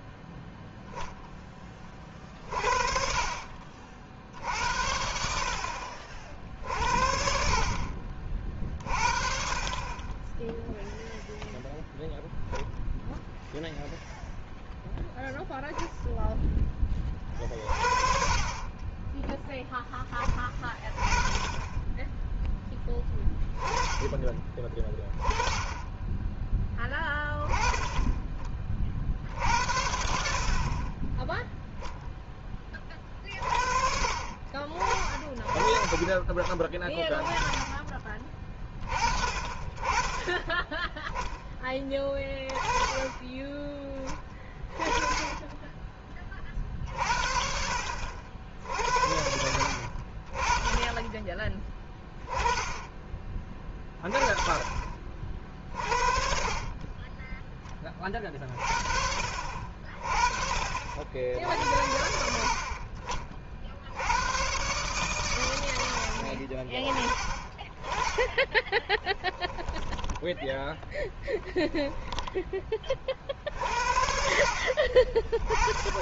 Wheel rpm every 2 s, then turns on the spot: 0, 50, 70, 60, 50, 0, 0, 0, 10, 20, 20, 10, 20, 10, 40, 40, 20, 40, 20, 30, 10, 20, 20, 30, 70, 30, 30, 40, 30, 50, 60, 60, 120, 50, 40, 10, 20, 60.
68-70